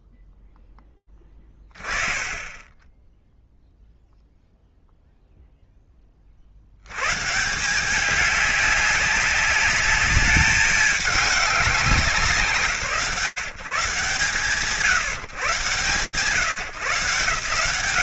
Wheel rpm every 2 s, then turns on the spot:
20, 0, 10, 180, 200, 170, 160, 140, 190.
none